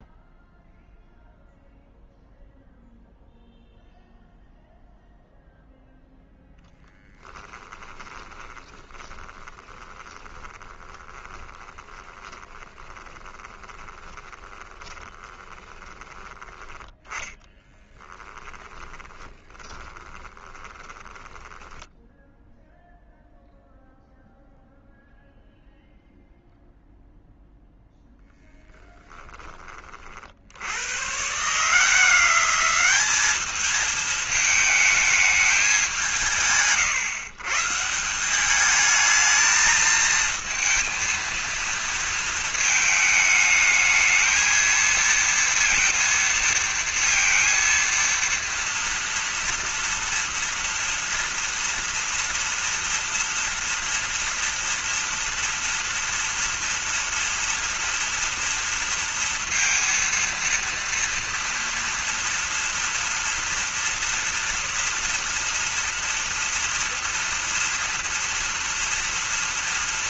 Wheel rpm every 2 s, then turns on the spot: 0, 0, 0, 10, 20, 30, 20, 20, 10, 10, 20, 0, 0, 0, 0, 90, 190, 220, 140, 210, 230, 220, 230, 230, 230, 230, 230, 230, 230, 230, 230, 230, 230, 240, 230.
6-16 18-22